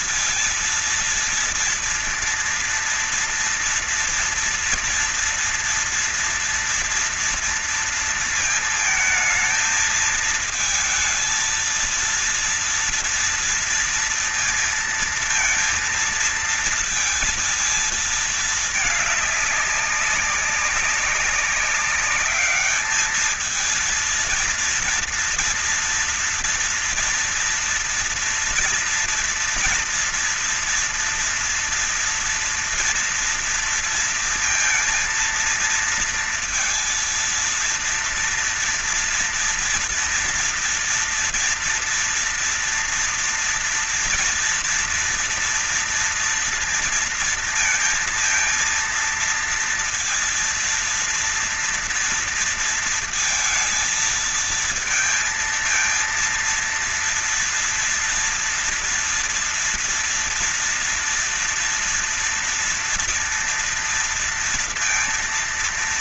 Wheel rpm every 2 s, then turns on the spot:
230, 230, 230, 230, 230, 220, 230, 230, 220, 220, 190, 210, 230, 230, 230, 230, 230, 230, 230, 230, 230, 240, 230, 230, 230, 230, 230, 220, 230, 230, 230, 230, 230.
none